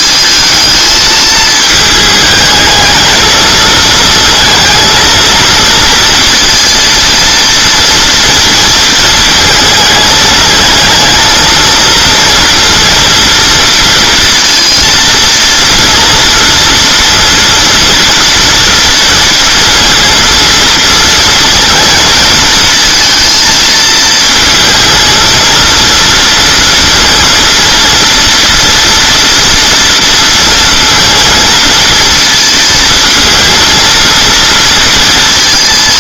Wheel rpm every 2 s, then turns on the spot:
220, 220, 230, 230, 220, 220, 230, 230, 230, 230, 230, 230, 230, 230, 230, 230, 230, 230.
none